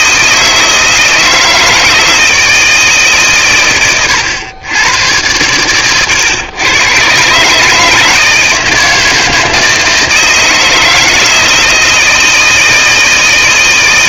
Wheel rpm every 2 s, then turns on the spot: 160, 160, 100, 120, 160, 160, 160.
none